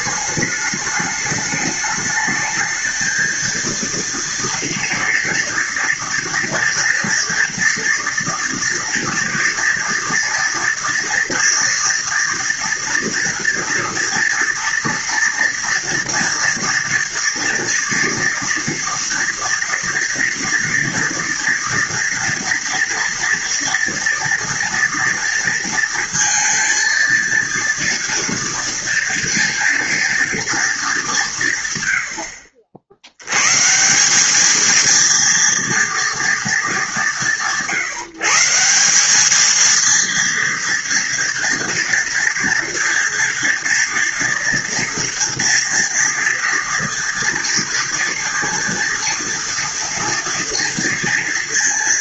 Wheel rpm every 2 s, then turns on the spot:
210, 220, 230, 230, 240, 230, 230, 230, 230, 230, 230, 230, 230, 230, 230, 220, 70, 210, 210, 170, 230, 230, 230, 230, 230, 230.
none